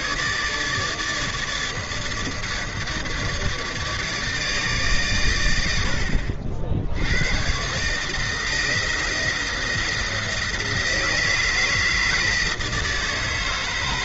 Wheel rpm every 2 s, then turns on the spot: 150, 150, 150, 70, 160, 170, 160.
none